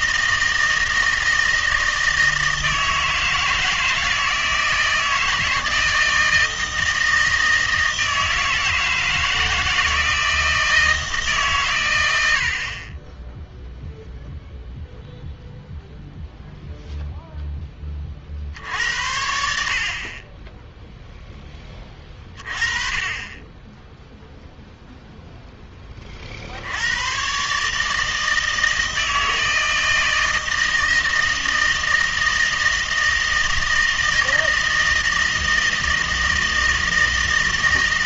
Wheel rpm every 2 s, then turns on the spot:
160, 160, 160, 160, 160, 160, 60, 0, 0, 70, 10, 20, 0, 70, 160, 160, 160, 160, 160.
none